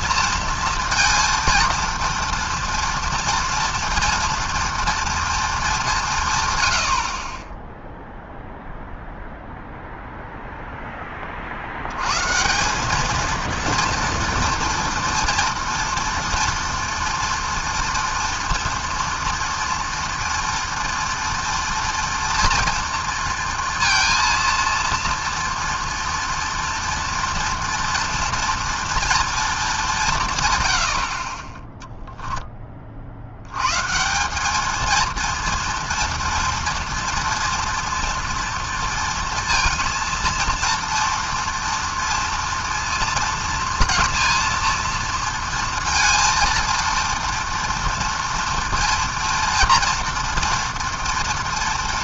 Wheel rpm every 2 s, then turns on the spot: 230, 230, 230, 40, 0, 30, 230, 230, 230, 230, 230, 230, 230, 230, 230, 20, 80, 230, 230, 230, 230, 230, 230, 240, 240, 230.
none